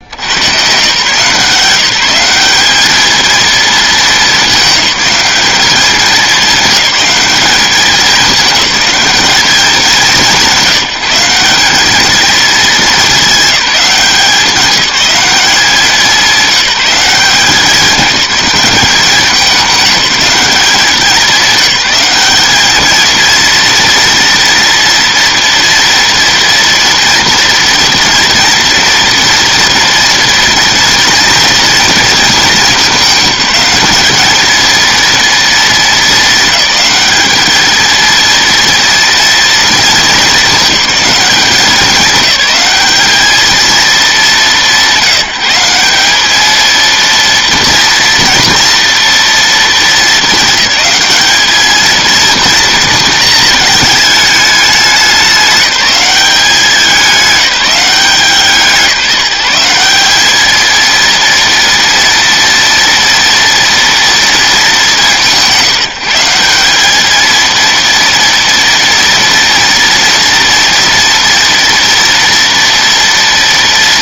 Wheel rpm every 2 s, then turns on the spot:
130, 220, 210, 200, 210, 190, 210, 200, 190, 200, 190, 220, 230, 230, 230, 230, 210, 230, 210, 230, 200, 200, 180, 230, 230, 210, 230, 200, 190, 170, 230, 240, 200, 210, 230, 230, 230.
none